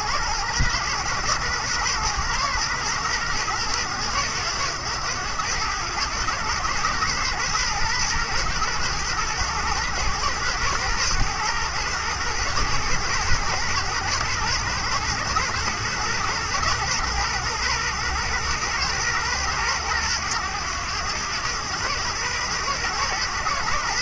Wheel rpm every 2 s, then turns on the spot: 110, 110, 100, 110, 120, 110, 110, 110, 120, 120, 100, 110.
none